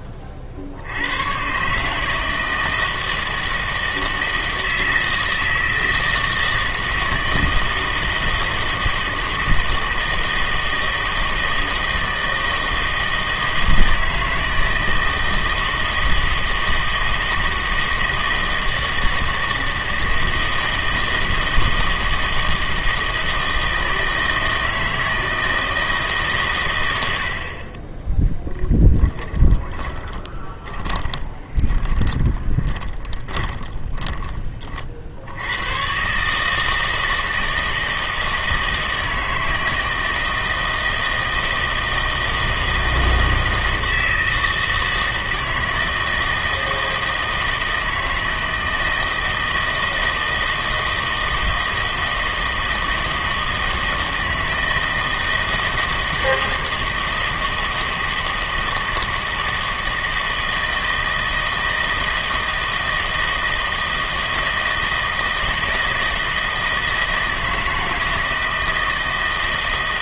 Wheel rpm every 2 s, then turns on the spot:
60, 160, 160, 160, 160, 160, 160, 160, 160, 160, 160, 160, 160, 120, 10, 20, 20, 30, 160, 160, 160, 160, 160, 160, 160, 160, 160, 160, 160, 160, 160, 160, 160, 160, 160.
28-34